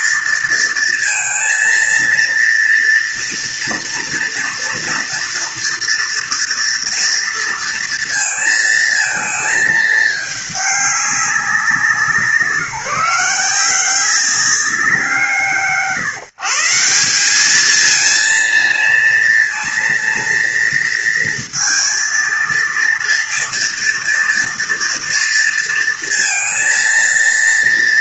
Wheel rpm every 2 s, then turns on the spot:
230, 240, 230, 230, 220, 200, 160, 170, 180, 230, 230, 230, 230, 220.
none